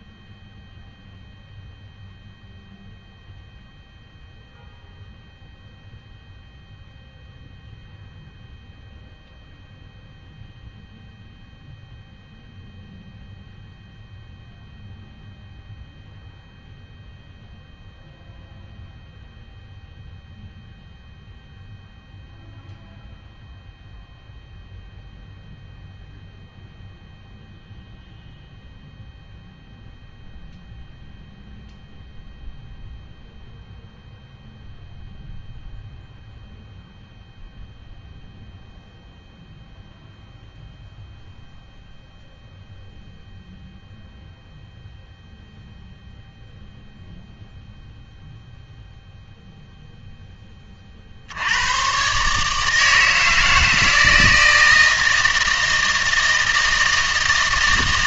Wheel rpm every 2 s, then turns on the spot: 0, 0, 0, 0, 0, 0, 0, 0, 0, 0, 0, 0, 0, 0, 0, 0, 0, 0, 0, 0, 0, 0, 0, 0, 0, 30, 150, 160, 170.
none